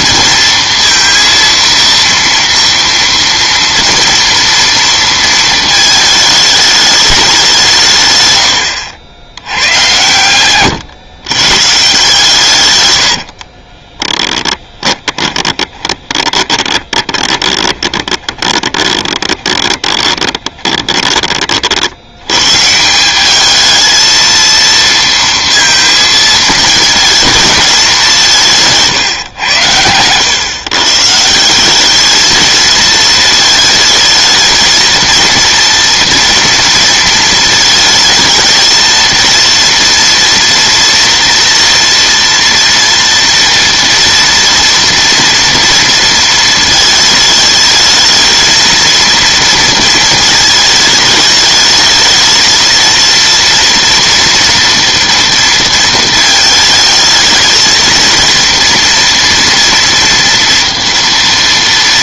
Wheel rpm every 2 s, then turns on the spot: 230, 230, 230, 210, 100, 120, 110, 10, 20, 20, 20, 160, 230, 220, 150, 130, 220, 220, 230, 230, 230, 230, 230, 220, 230, 220, 230, 230, 220, 240, 230.
14-22